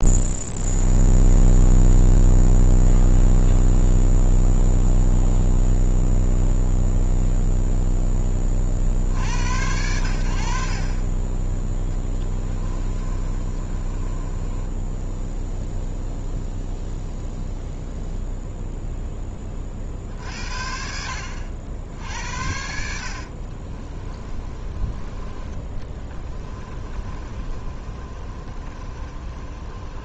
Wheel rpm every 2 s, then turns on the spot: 0, 0, 0, 0, 30, 60, 20, 20, 0, 0, 60, 70, 30, 20, 30.
12-16 24-30